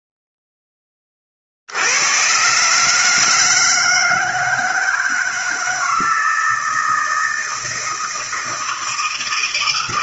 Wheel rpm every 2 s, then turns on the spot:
40, 150, 160, 160, 160.
none